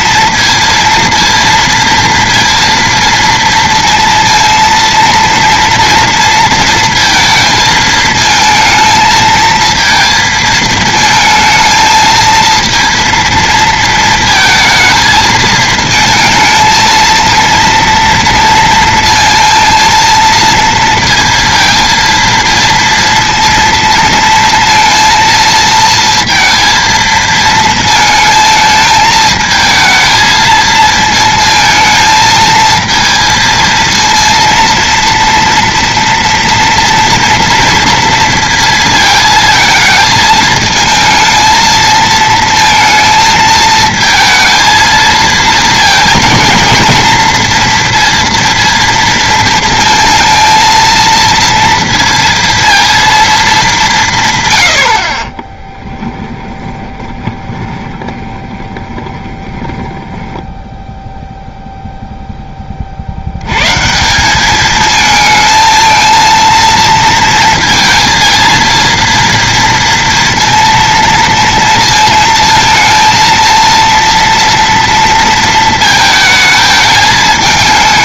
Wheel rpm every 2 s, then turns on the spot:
230, 230, 230, 230, 220, 220, 230, 220, 230, 230, 230, 230, 230, 230, 220, 220, 230, 230, 230, 230, 220, 230, 230, 230, 230, 230, 230, 80, 20, 20, 0, 40, 220, 230, 230, 230, 230, 230, 220.
56-60